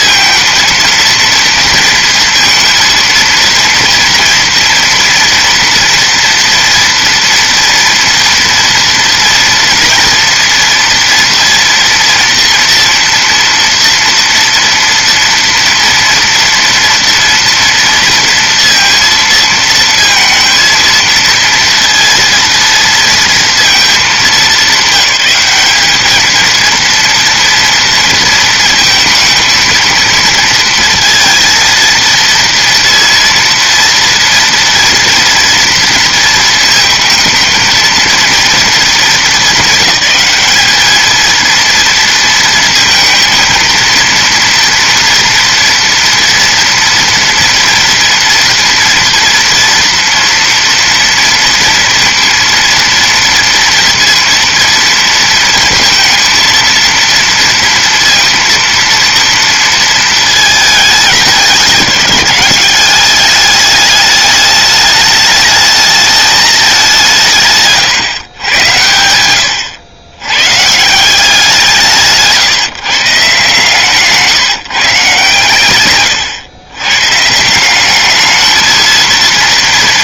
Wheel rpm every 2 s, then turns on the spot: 230, 230, 230, 230, 230, 230, 240, 230, 230, 230, 230, 230, 210, 230, 230, 230, 230, 230, 220, 220, 210, 230, 230, 240, 230, 230, 230, 230, 230, 230, 210, 200, 210, 190, 100, 160, 160, 150, 120, 220.
none